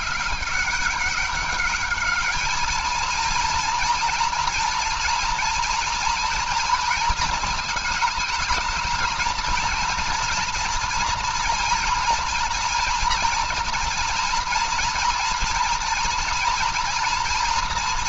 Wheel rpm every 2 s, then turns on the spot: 200, 220, 230, 230, 220, 230, 230, 230, 240.
none